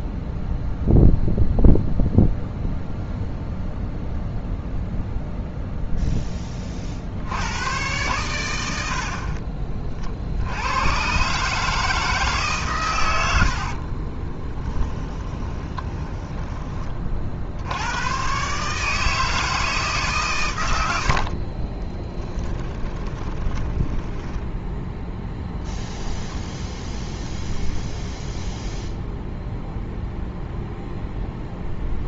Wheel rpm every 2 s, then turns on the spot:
0, 0, 0, 30, 80, 100, 130, 10, 20, 140, 100, 30, 10, 0, 0, 0.
14-16 22-24